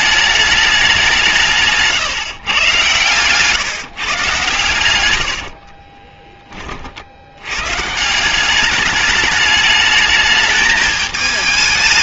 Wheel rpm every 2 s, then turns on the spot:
200, 120, 110, 40, 200, 220.
none